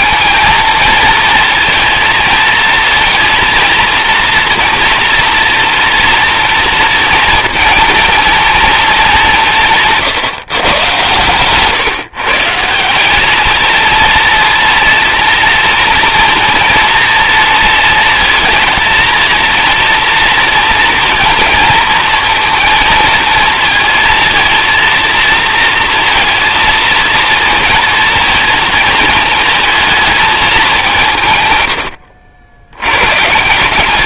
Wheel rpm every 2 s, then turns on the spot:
230, 230, 230, 230, 210, 120, 190, 230, 230, 230, 230, 230, 230, 230, 220, 180, 100.
none